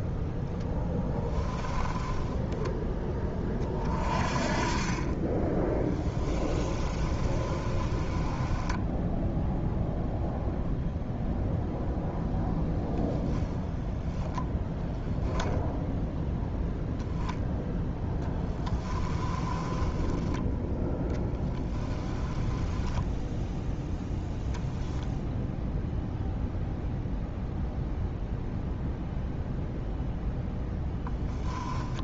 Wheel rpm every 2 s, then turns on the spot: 10, 10, 30, 20, 10, 0, 0, 10, 0, 10, 10, 10, 0, 0, 0, 10.
0-4 6-10 18-20 22-24 30-32